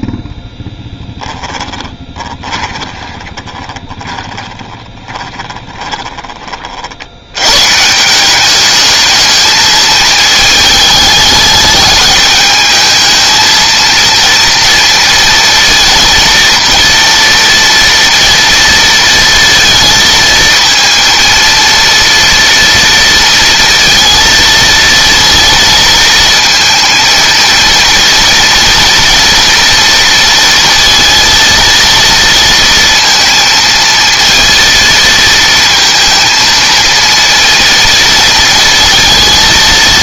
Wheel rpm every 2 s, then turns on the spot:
10, 20, 20, 60, 210, 210, 220, 230, 230, 230, 230, 230, 230, 230, 230, 230, 230, 230, 230, 220.
0-6